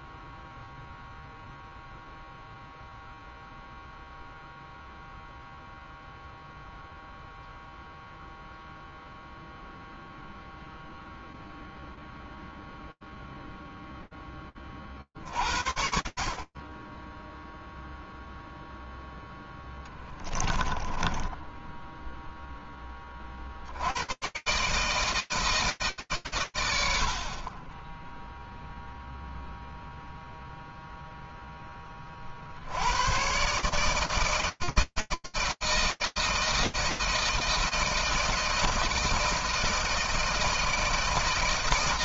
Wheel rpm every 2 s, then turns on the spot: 0, 0, 0, 0, 0, 0, 0, 60, 0, 10, 10, 80, 160, 100, 0, 10, 130, 160, 160, 160, 160.
18-22